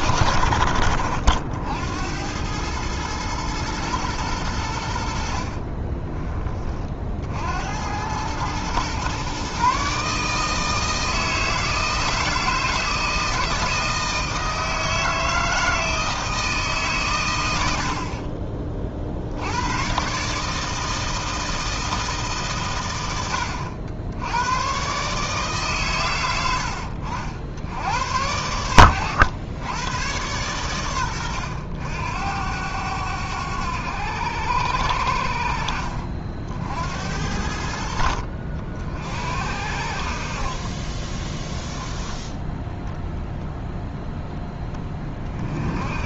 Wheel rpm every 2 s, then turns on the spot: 70, 110, 90, 30, 120, 160, 160, 160, 150, 40, 160, 110, 130, 80, 90, 110, 90, 80, 70, 50, 30, 10, 20.
none